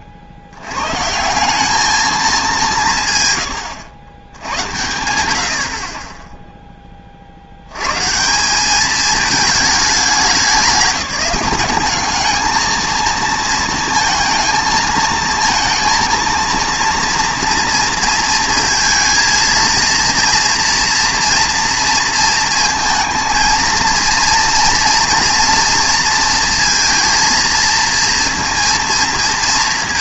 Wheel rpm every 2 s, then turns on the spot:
70, 170, 100, 20, 200, 180, 220, 220, 230, 230, 240, 230, 230, 230, 230.
none